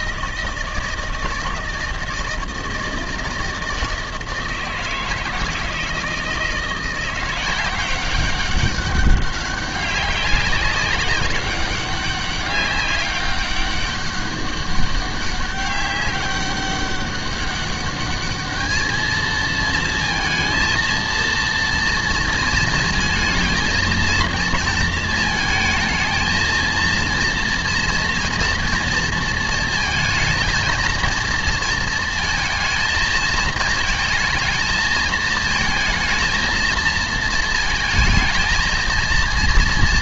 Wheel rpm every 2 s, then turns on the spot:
160, 160, 160, 170, 200, 190, 200, 200, 200, 210, 230, 230, 230, 230, 230, 220, 220, 220, 230, 230.
none